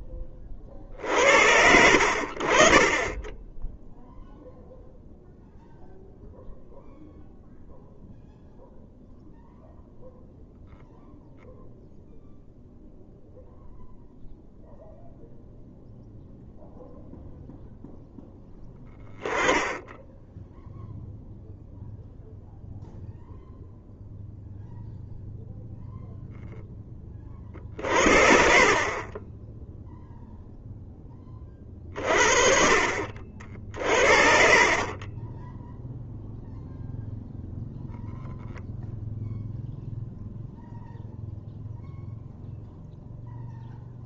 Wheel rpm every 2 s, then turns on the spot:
50, 40, 0, 0, 0, 0, 0, 0, 0, 0, 0, 0, 0, 10, 30, 0, 50, 50, 0, 0, 0, 0.
28-30 34-36